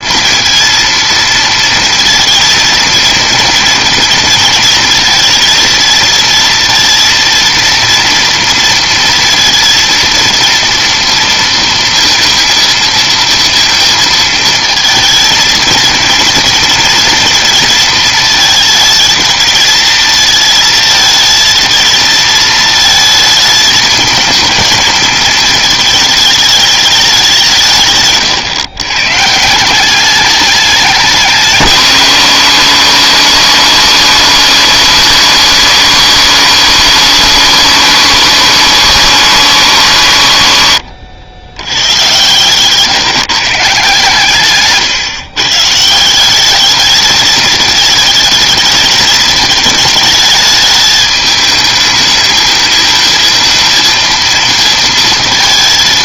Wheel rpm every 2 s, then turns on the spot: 230, 230, 220, 230, 230, 230, 230, 220, 230, 220, 220, 220, 230, 210, 120, 200, 180, 170, 160, 160, 100, 140, 140, 200, 220, 210, 220, 230.
none